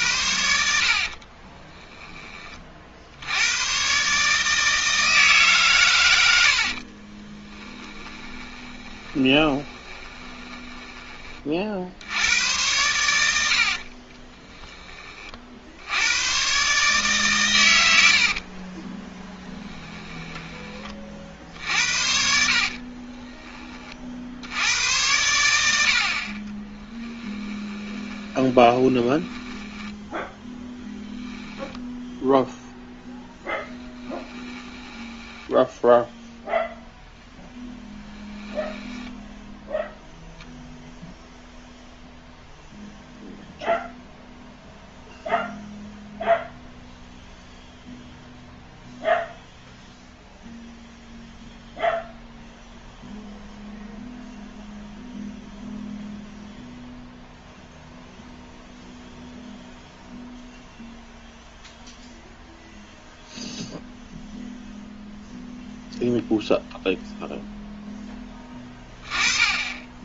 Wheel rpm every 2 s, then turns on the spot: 60, 40, 160, 50, 20, 20, 110, 10, 140, 30, 30, 50, 90, 20, 20, 0, 0, 10, 0, 10, 0, 0, 0, 0, 0, 0, 0, 0, 0, 0, 0, 0, 0, 0, 20.
0-2 6-12 18-20 22-24 26-30 34-36 38-40 68-70